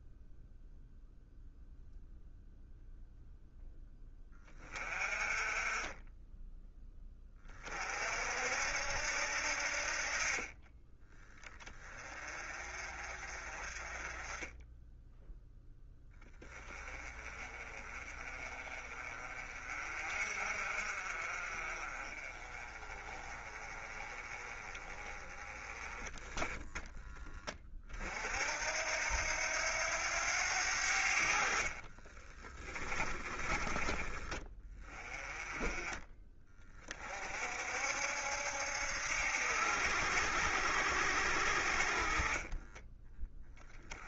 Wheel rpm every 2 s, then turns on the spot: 0, 0, 20, 10, 60, 20, 40, 10, 20, 30, 40, 30, 20, 10, 70, 70, 30, 20, 30, 70, 80, 20.
32-34